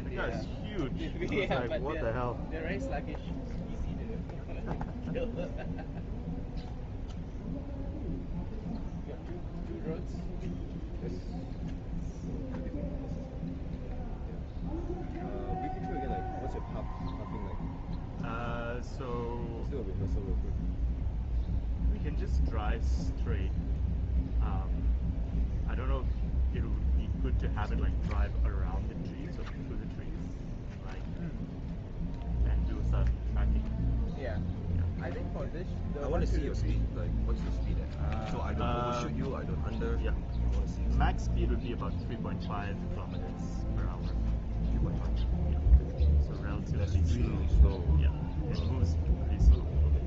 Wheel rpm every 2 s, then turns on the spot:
0, 0, 0, 0, 0, 0, 0, 0, 0, 0, 0, 0, 0, 0, 0, 0, 0, 0, 0, 0, 0, 0, 0, 0, 0.
none